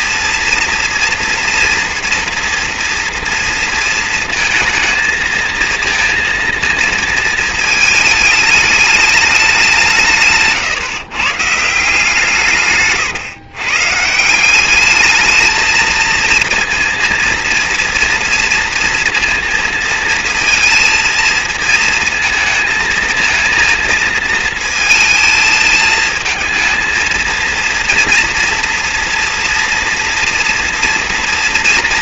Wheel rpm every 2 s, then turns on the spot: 230, 230, 230, 230, 210, 140, 130, 190, 230, 230, 230, 220, 220, 220, 230, 240.
none